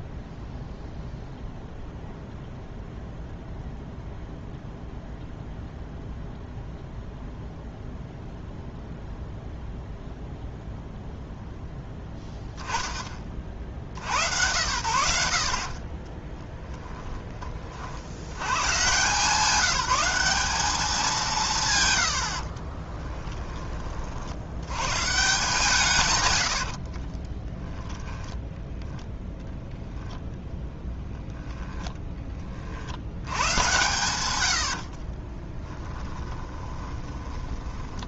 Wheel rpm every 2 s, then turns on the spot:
0, 0, 0, 0, 0, 0, 0, 100, 20, 110, 200, 50, 80, 90, 10, 0, 30, 90, 20.
16-18 22-24 26-28 36-38